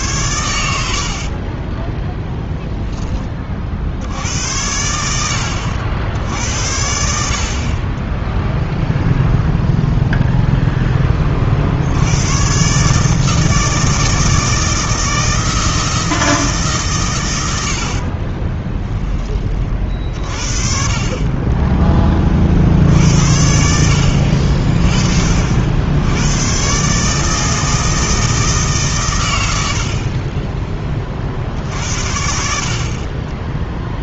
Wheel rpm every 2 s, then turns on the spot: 80, 0, 80, 80, 0, 0, 130, 160, 150, 20, 40, 50, 40, 120, 150, 20, 50.
18-20